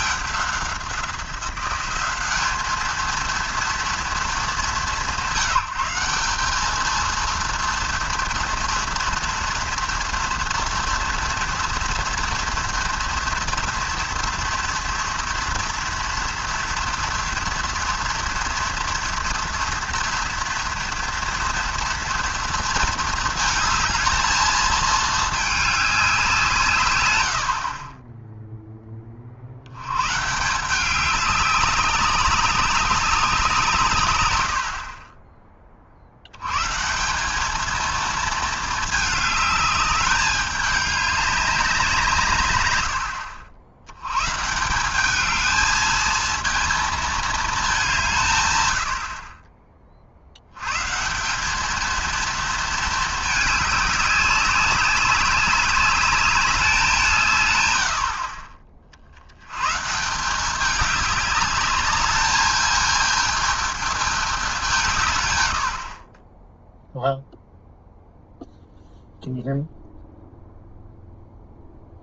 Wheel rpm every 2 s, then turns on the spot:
190, 220, 190, 210, 230, 230, 230, 230, 230, 230, 230, 220, 220, 140, 10, 190, 200, 70, 140, 220, 200, 110, 180, 230, 100, 120, 220, 200, 190, 40, 200, 220, 200, 0, 0, 0.
none